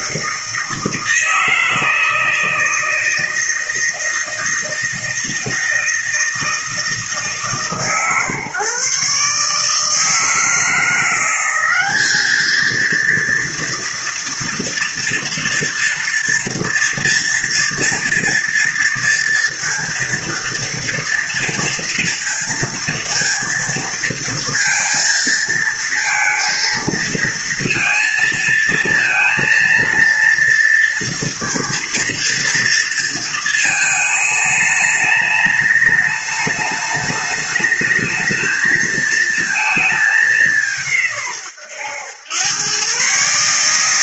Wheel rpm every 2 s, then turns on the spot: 160, 160, 160, 160, 150, 160, 220, 230, 230, 230, 230, 230, 230, 230, 230, 240, 230, 210, 210, 220, 200, 110.
none